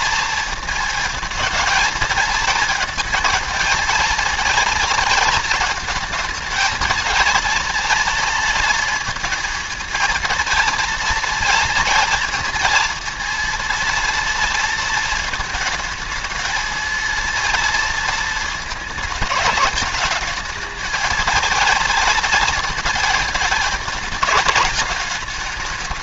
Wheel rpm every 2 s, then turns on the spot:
230, 220, 230, 230, 230, 230, 230, 230, 230, 220, 220, 220, 210.
none